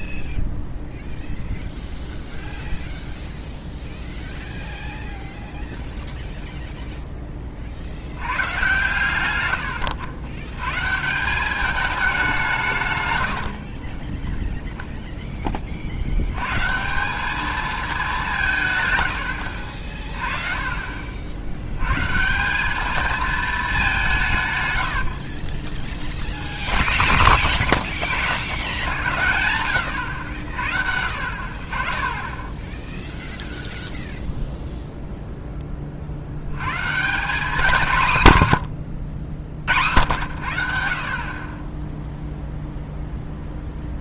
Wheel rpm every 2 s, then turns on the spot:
0, 0, 0, 0, 130, 130, 140, 0, 150, 90, 40, 200, 100, 10, 90, 60, 0, 0, 120, 110, 70, 0.
none